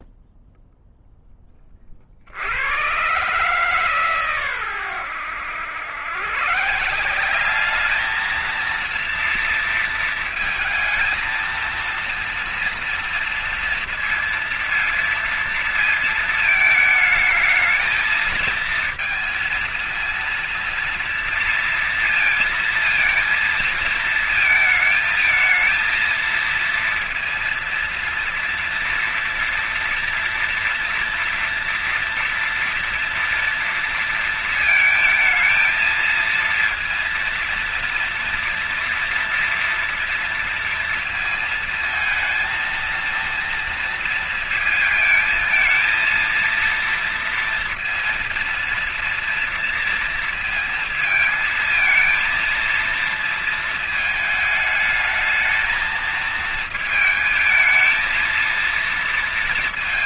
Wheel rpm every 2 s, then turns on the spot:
0, 70, 130, 130, 220, 230, 230, 230, 220, 220, 230, 230, 220, 230, 240, 230, 230, 230, 230, 230, 230, 230, 230, 220, 230, 230, 230, 220, 220, 230.
none